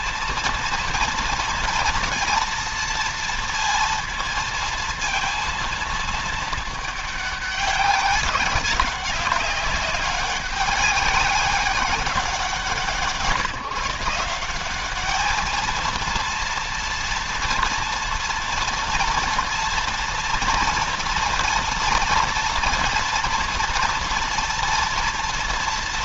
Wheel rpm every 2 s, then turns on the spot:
230, 230, 220, 210, 200, 200, 170, 200, 230, 230, 230, 230, 230.
none